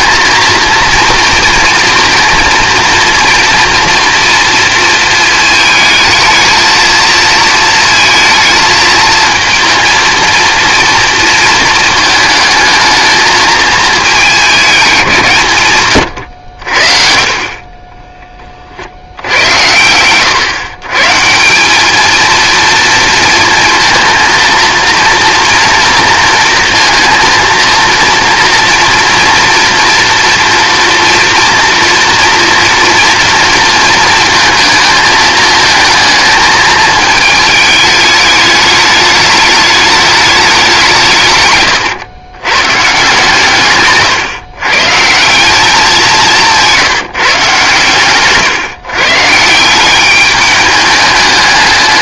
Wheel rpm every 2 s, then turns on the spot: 230, 230, 230, 220, 220, 230, 220, 200, 60, 50, 130, 230, 230, 230, 230, 230, 230, 220, 220, 210, 190, 130, 130, 180, 130, 210.
none